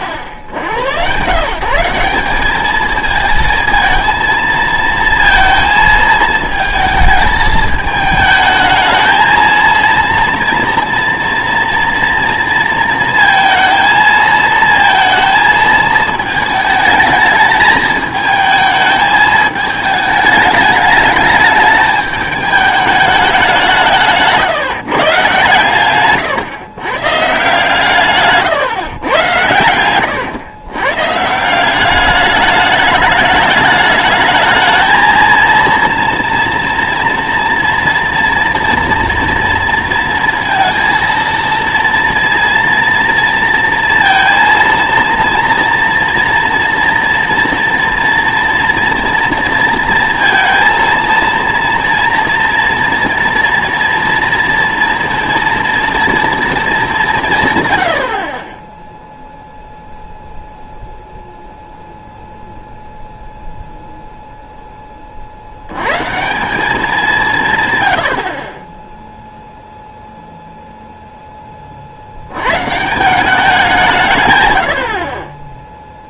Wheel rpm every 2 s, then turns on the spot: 100, 210, 230, 220, 220, 230, 230, 230, 220, 220, 210, 210, 160, 130, 130, 120, 210, 220, 230, 230, 230, 230, 230, 230, 230, 230, 230, 230, 210, 10, 0, 0, 10, 190, 20, 0, 130, 90.
none